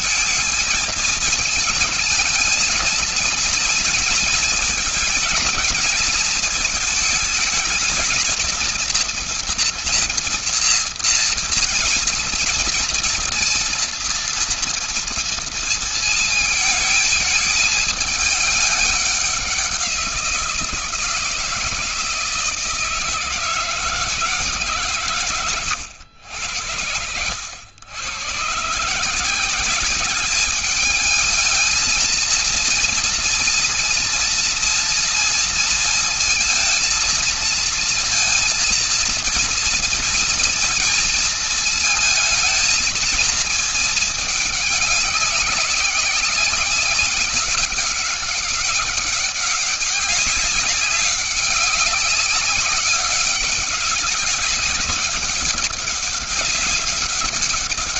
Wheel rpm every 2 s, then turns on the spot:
220, 230, 230, 220, 220, 230, 230, 230, 220, 210, 170, 160, 150, 80, 130, 210, 230, 230, 230, 230, 230, 230, 200, 200, 190, 200, 200, 190, 190.
none